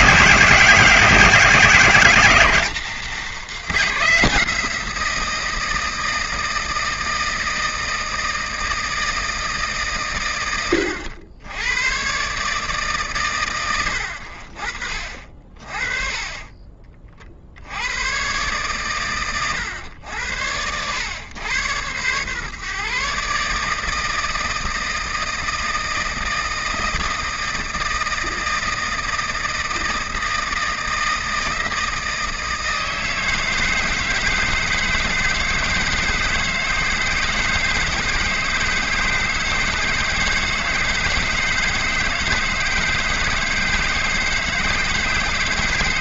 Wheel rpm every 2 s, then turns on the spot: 190, 200, 170, 160, 160, 90, 120, 40, 30, 120, 100, 130, 160, 160, 160, 160, 160, 160, 160, 160, 160, 160, 160.
none